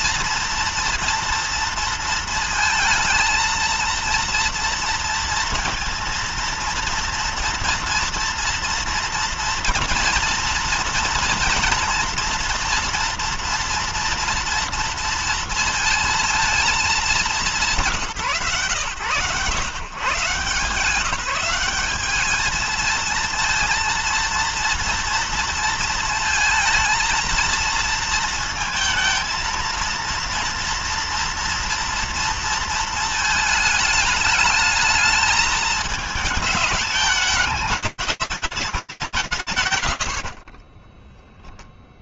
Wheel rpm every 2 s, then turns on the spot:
230, 230, 230, 230, 230, 230, 240, 230, 230, 130, 150, 210, 230, 230, 230, 230, 230, 210, 210, 170, 30.
none